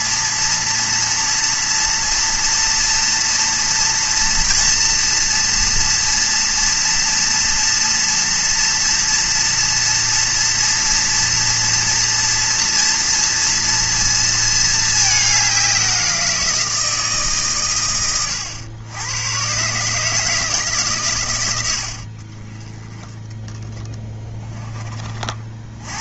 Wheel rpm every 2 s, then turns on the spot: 230, 230, 230, 230, 240, 230, 230, 210, 160, 100, 140, 10, 30.
none